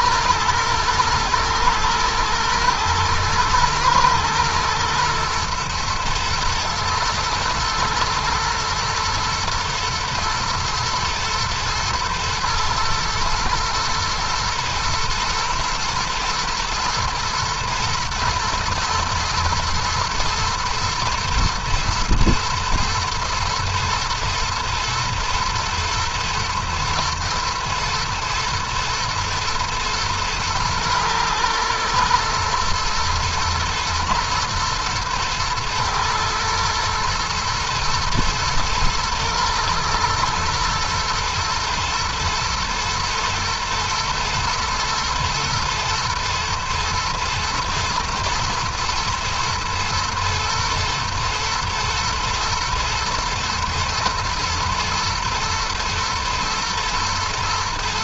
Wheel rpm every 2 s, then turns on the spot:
120, 110, 110, 110, 110, 110, 120, 110, 120, 110, 120, 110, 110, 120, 110, 110, 120, 110, 110, 120, 110, 110, 120, 110, 120, 120, 120, 120, 120.
none